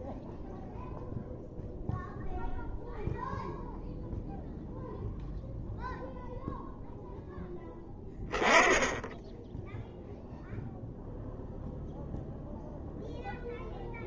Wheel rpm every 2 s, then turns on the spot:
0, 0, 0, 0, 10, 0, 0.
none